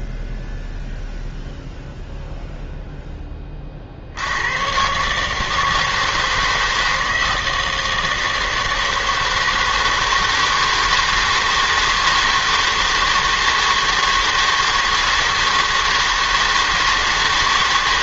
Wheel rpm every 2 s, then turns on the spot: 0, 0, 100, 160, 160, 160, 160, 160, 160.
none